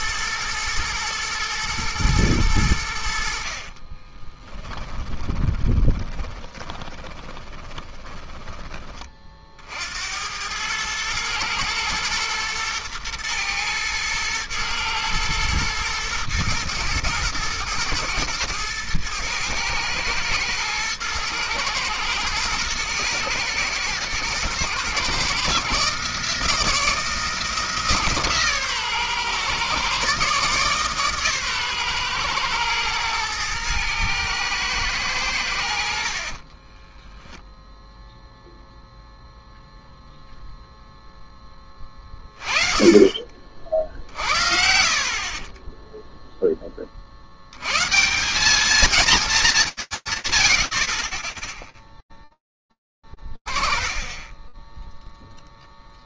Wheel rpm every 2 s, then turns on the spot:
110, 100, 10, 20, 20, 100, 110, 110, 110, 110, 110, 110, 120, 160, 140, 140, 120, 110, 20, 0, 0, 20, 60, 20, 210, 10, 20, 0.
4-8 36-38